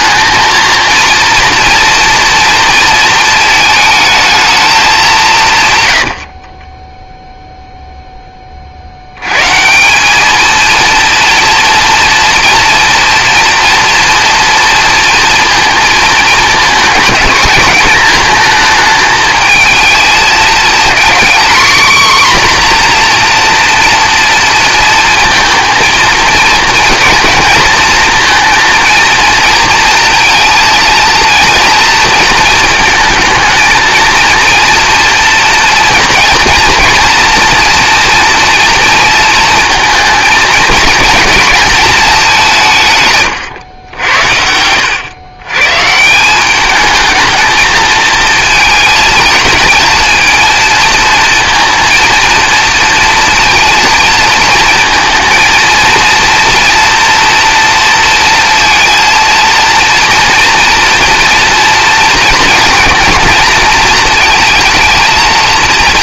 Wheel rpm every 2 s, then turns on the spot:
230, 230, 200, 20, 70, 230, 230, 230, 210, 220, 230, 250, 230, 230, 230, 230, 220, 230, 240, 230, 230, 150, 90, 210, 220, 230, 230, 230, 240, 230, 240, 230, 220.
6-8